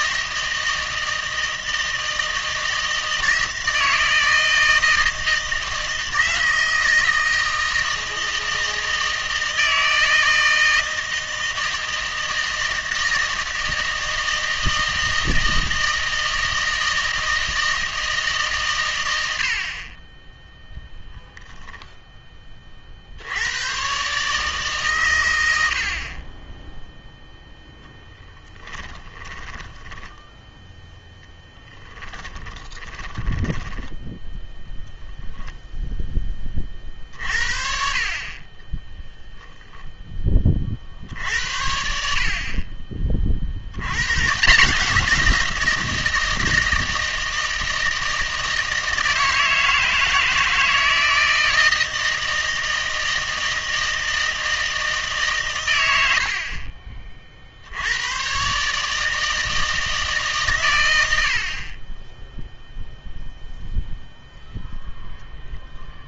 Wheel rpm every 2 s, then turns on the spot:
160, 160, 160, 160, 160, 160, 160, 160, 160, 120, 0, 40, 140, 10, 10, 0, 20, 0, 40, 10, 40, 40, 180, 160, 160, 160, 160, 160, 40, 140, 110, 0, 0.
28-30 32-34 38-40